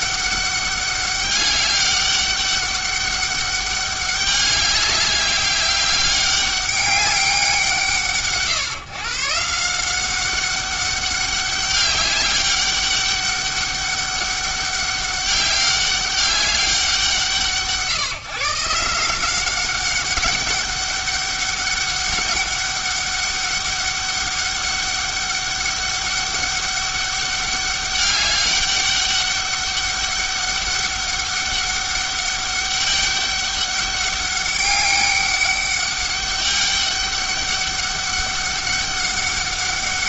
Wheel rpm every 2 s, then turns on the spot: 200, 200, 200, 200, 130, 200, 200, 200, 180, 160, 200, 200, 200, 200, 200, 200, 200, 200, 200, 200.
none